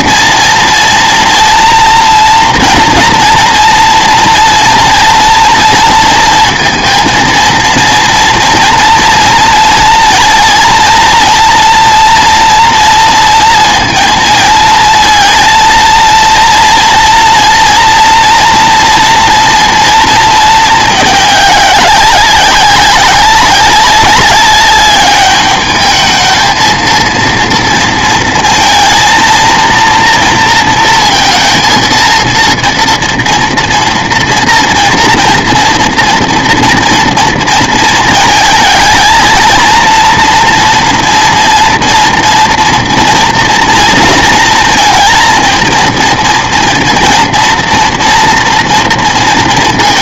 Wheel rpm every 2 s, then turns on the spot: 230, 230, 230, 230, 230, 230, 230, 230, 230, 230, 220, 190, 200, 220, 230, 230, 230, 230, 230, 220, 230, 230, 230, 230, 230.
none